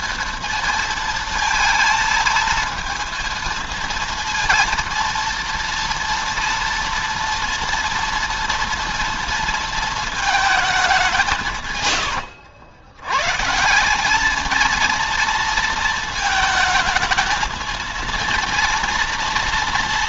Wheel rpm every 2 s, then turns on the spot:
230, 230, 230, 230, 230, 200, 90, 220, 220, 230.
none